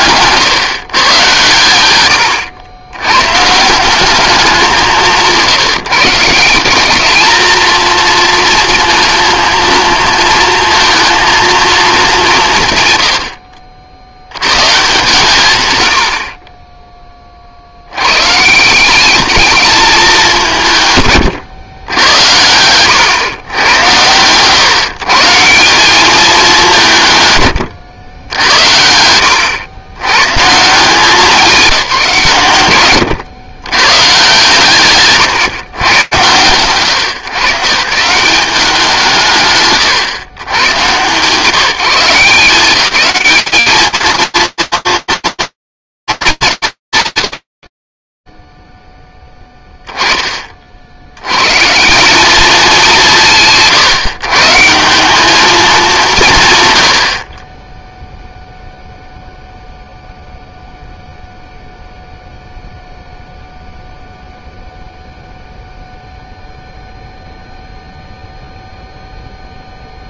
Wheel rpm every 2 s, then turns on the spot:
130, 100, 190, 210, 230, 230, 140, 120, 20, 180, 160, 100, 130, 180, 80, 160, 110, 150, 110, 170, 110, 190, 230, 180, 0, 40, 200, 150, 130, 0, 0, 0, 0, 0, 0.
none